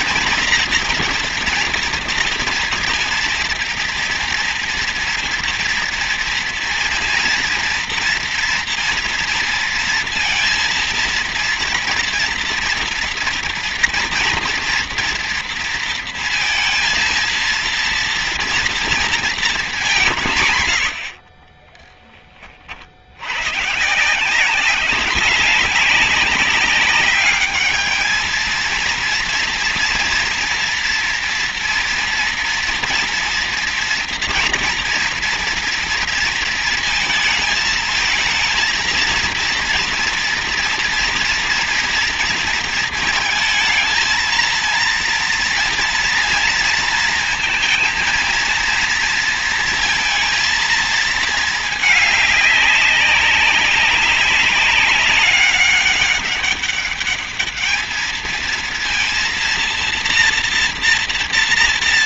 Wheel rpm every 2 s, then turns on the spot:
230, 230, 240, 240, 230, 230, 230, 230, 230, 230, 80, 90, 190, 200, 230, 230, 230, 230, 220, 230, 230, 230, 230, 230, 230, 220, 200, 200, 200, 230, 230.
none